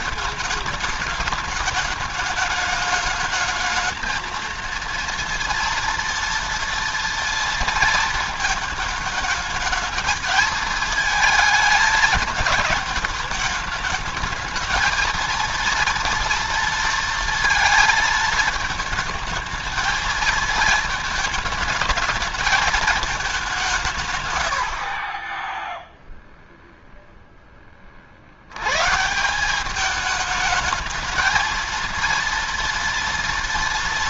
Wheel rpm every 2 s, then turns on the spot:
220, 210, 230, 230, 230, 220, 220, 220, 230, 220, 220, 220, 110, 0, 100, 220, 230.
none